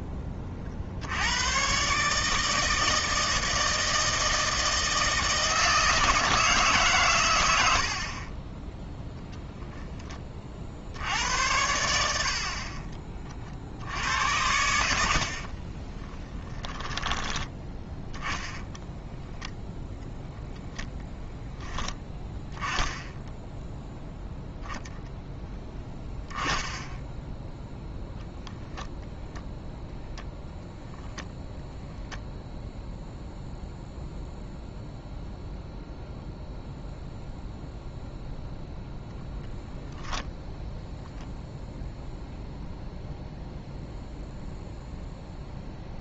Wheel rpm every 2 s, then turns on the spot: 40, 160, 160, 140, 10, 60, 40, 70, 20, 10, 10, 10, 0, 10, 0, 0, 0, 0, 0, 0, 0, 0, 0.
12-14 16-22